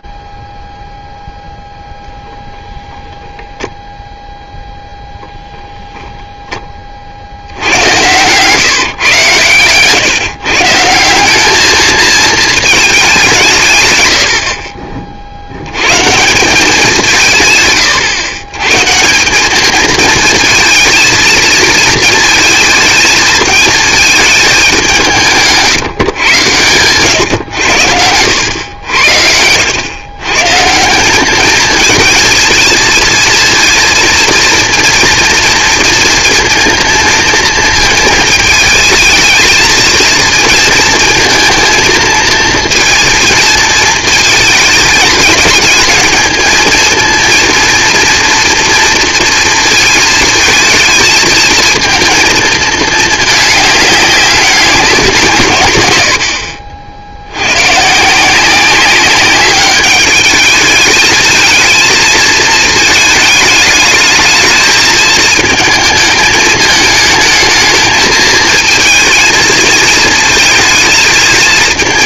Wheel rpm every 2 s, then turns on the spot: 10, 0, 0, 30, 150, 170, 210, 40, 190, 160, 230, 230, 180, 120, 90, 190, 230, 230, 230, 220, 230, 230, 220, 230, 230, 220, 220, 180, 80, 190, 220, 220, 220, 220, 220, 220.
26-28